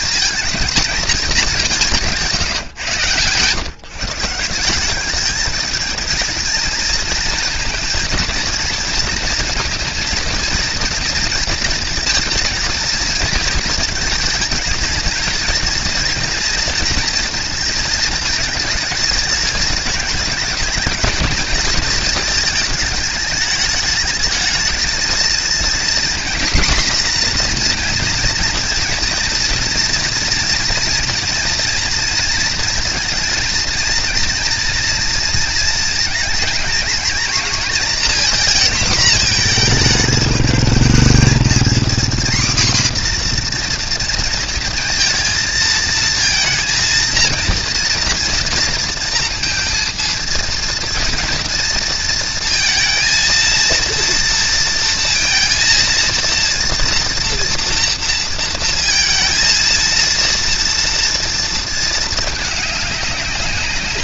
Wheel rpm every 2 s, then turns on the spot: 210, 150, 170, 230, 220, 230, 230, 220, 230, 220, 220, 220, 220, 250, 230, 230, 230, 230, 230, 230, 210, 250, 230, 230, 230, 230, 230, 230, 230, 230, 230, 210.
none